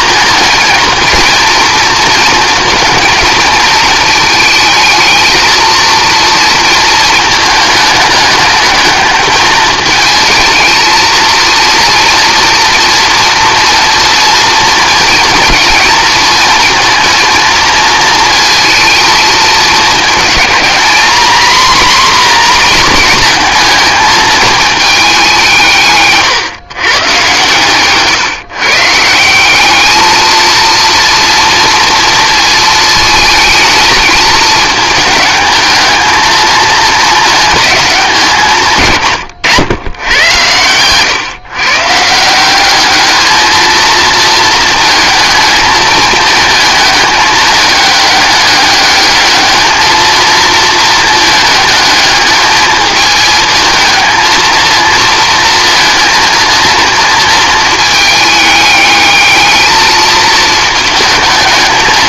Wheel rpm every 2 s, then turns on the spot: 230, 230, 220, 230, 210, 220, 230, 230, 230, 230, 230, 250, 220, 130, 150, 230, 230, 220, 220, 150, 120, 200, 220, 220, 210, 220, 220, 230, 230, 210, 220.
none